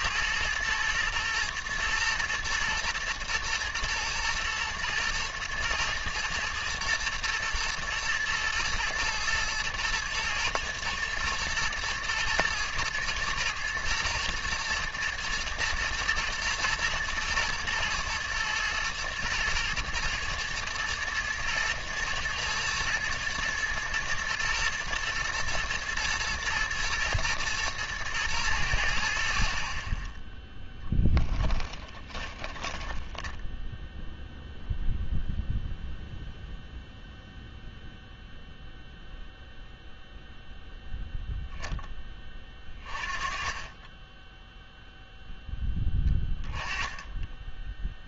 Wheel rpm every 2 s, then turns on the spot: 120, 120, 120, 110, 110, 110, 110, 120, 120, 110, 120, 110, 120, 120, 90, 0, 10, 0, 0, 0, 0, 30, 0, 20.
32-34 46-48